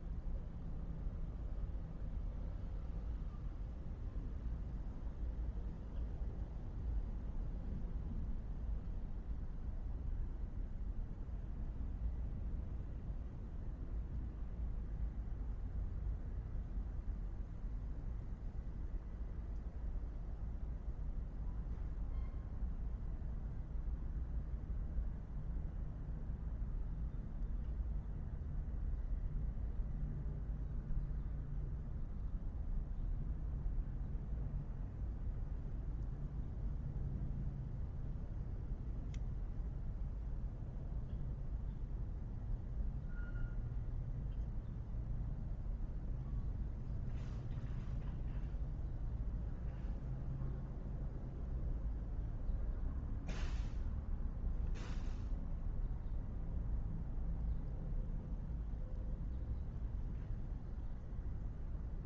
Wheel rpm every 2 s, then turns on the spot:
0, 0, 0, 0, 0, 0, 0, 0, 0, 0, 0, 0, 0, 0, 0, 0, 0, 0, 0, 0, 0, 0, 0, 0, 0, 0, 0, 0, 0, 0, 0.
none